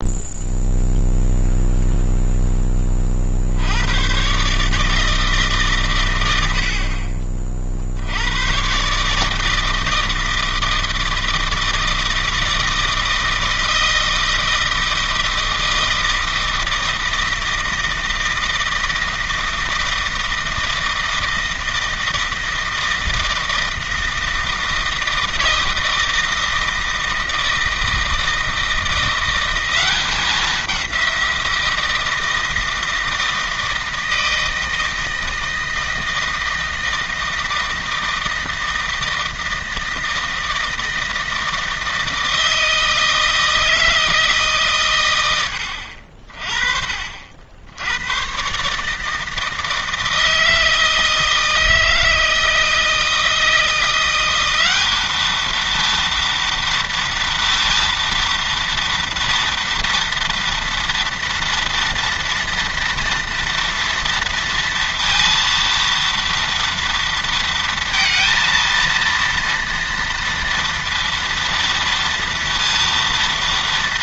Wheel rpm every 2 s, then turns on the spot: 0, 20, 150, 50, 130, 160, 160, 160, 160, 160, 160, 160, 160, 160, 170, 190, 160, 160, 160, 160, 160, 160, 140, 40, 150, 160, 160, 200, 230, 240, 230, 230, 230, 230, 230, 230, 230.
none